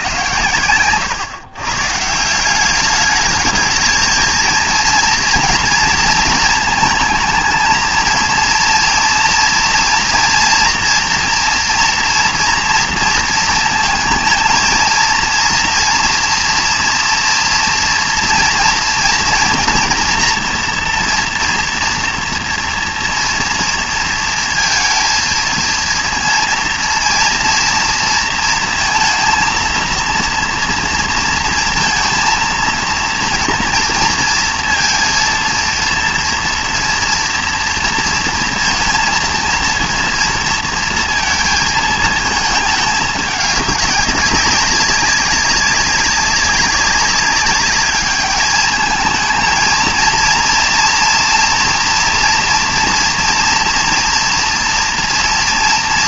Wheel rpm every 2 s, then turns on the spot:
120, 200, 230, 220, 230, 230, 230, 230, 230, 230, 240, 230, 230, 230, 230, 230, 230, 230, 230, 230, 230, 220, 200, 200, 210, 230, 240, 230.
none